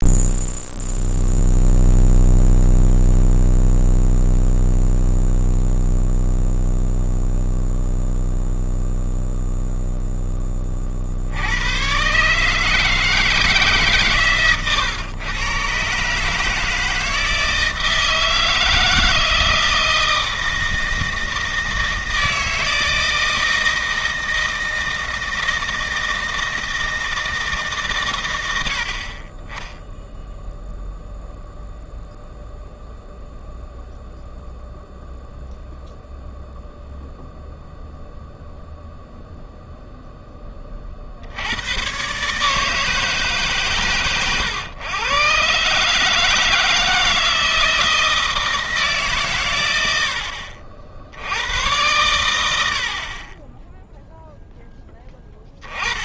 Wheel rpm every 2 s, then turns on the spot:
0, 0, 0, 0, 0, 30, 150, 120, 160, 160, 160, 160, 160, 160, 80, 0, 0, 0, 0, 0, 30, 150, 120, 160, 160, 60, 80, 10.
14-16